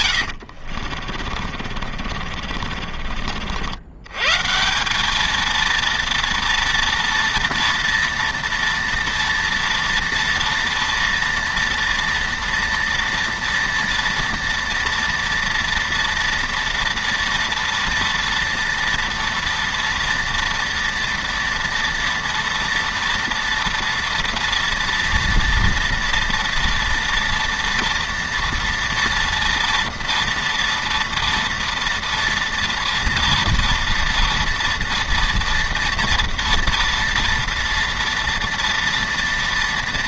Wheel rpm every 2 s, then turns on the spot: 50, 50, 180, 230, 230, 230, 230, 230, 230, 230, 230, 230, 230, 230, 230, 230, 230, 230, 230, 230.
0-4